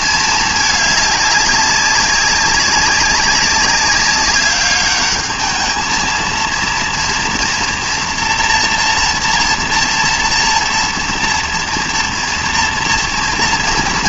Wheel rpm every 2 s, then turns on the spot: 210, 200, 200, 230, 230, 230, 230.
none